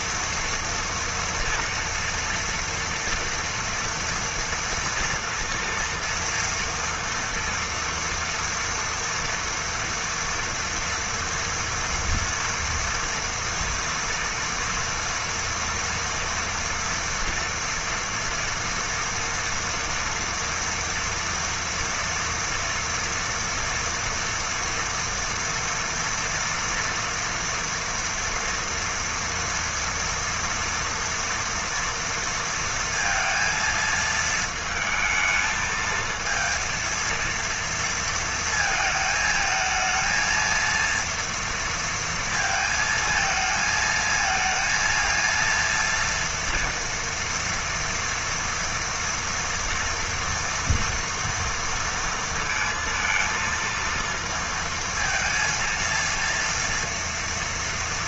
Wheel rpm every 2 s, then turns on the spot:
240, 230, 230, 230, 230, 230, 230, 230, 230, 230, 240, 240, 230, 230, 230, 240, 230, 220, 230, 220, 230, 220, 230, 230, 230, 230, 230, 230, 230.
none